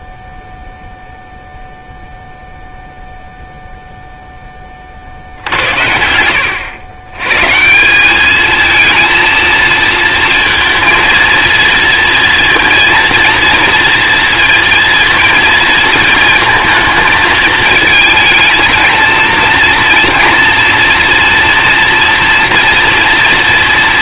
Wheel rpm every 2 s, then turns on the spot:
0, 0, 0, 80, 210, 230, 230, 230, 220, 220, 230, 230.
none